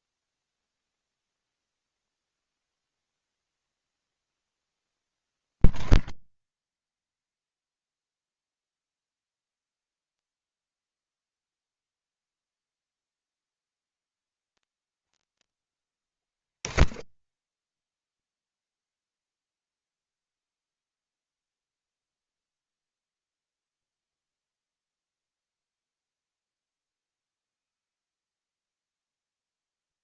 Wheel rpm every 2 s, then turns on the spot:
0, 0, 0, 0, 0, 0, 0, 0, 0, 0, 0, 0, 0, 0, 0.
none